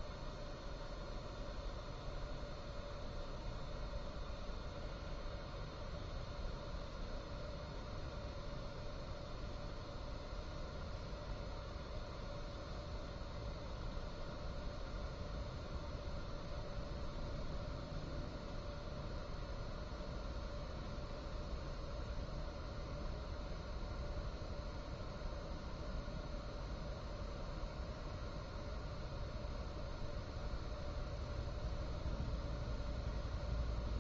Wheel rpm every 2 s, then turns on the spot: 0, 0, 0, 0, 0, 0, 0, 0, 0, 0, 0, 0, 0, 0, 0, 0, 0.
none